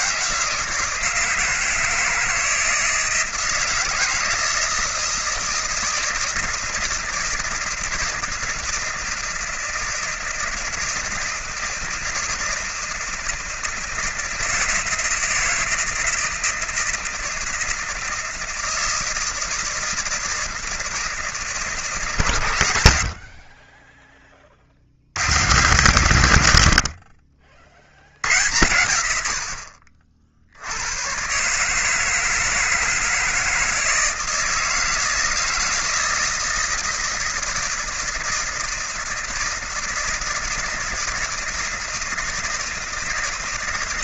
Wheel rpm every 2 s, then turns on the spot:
160, 160, 160, 160, 160, 160, 160, 160, 160, 160, 160, 120, 30, 110, 90, 60, 160, 160, 160, 160, 160, 160.
none